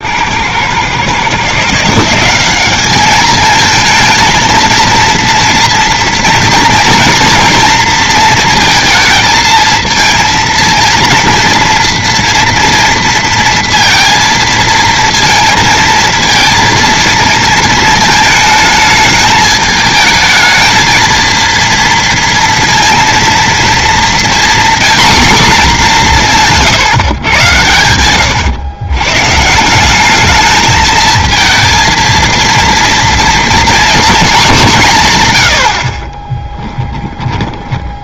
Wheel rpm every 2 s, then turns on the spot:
120, 190, 230, 230, 230, 230, 230, 230, 230, 220, 220, 230, 240, 150, 120, 210, 230, 190, 10.
26-28 36-38